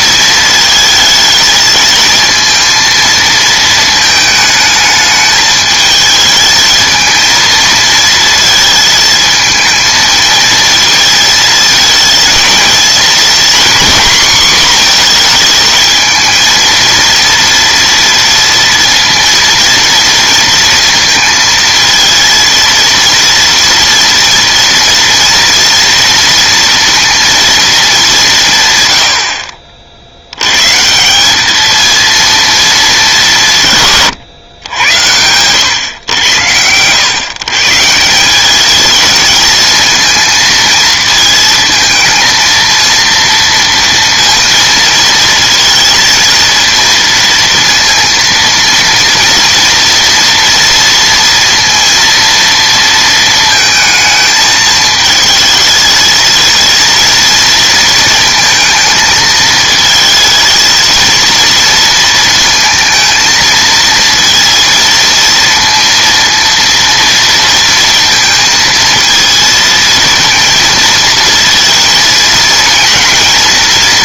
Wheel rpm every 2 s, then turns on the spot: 220, 230, 220, 220, 220, 220, 230, 240, 230, 230, 230, 230, 240, 230, 140, 130, 220, 100, 110, 210, 230, 230, 230, 230, 230, 230, 230, 220, 230, 220, 230, 230, 230, 230, 230, 230, 230.
none